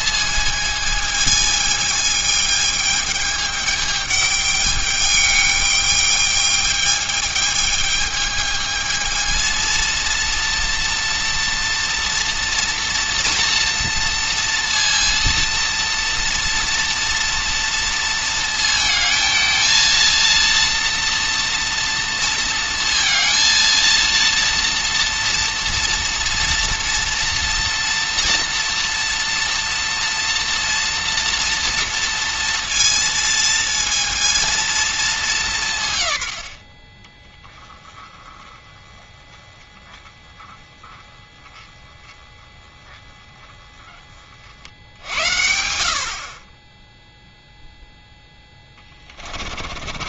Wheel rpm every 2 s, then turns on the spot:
220, 210, 210, 210, 220, 230, 230, 230, 230, 230, 230, 230, 230, 230, 230, 230, 230, 230, 40, 10, 10, 20, 60, 10, 20.
48-50